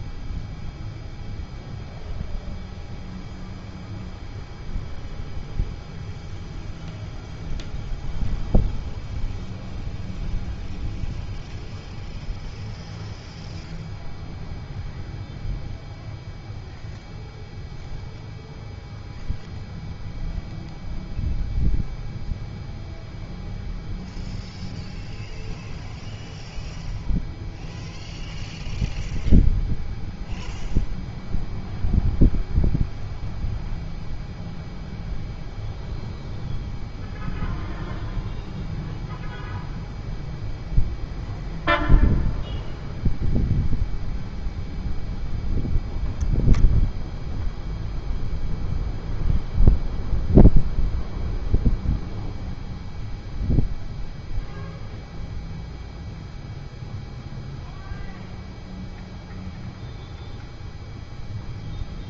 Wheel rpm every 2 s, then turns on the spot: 0, 0, 0, 0, 0, 0, 0, 0, 0, 0, 0, 0, 0, 0, 0, 0, 0, 0, 0, 0, 0, 0, 0, 0, 0, 0, 0, 0, 0, 0, 0.
none